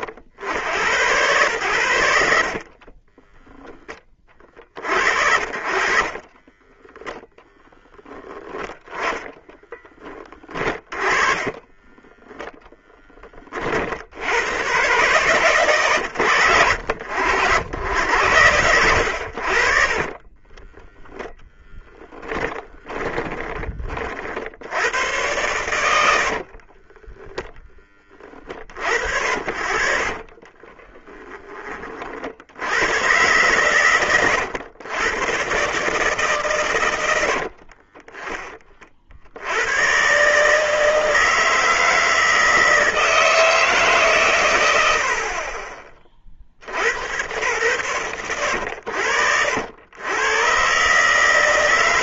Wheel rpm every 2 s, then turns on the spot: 100, 30, 50, 20, 20, 30, 10, 110, 90, 90, 10, 30, 90, 30, 60, 10, 100, 110, 100, 40, 160, 160, 80, 70, 70, 140.
2-4 6-12 20-24 26-28 30-32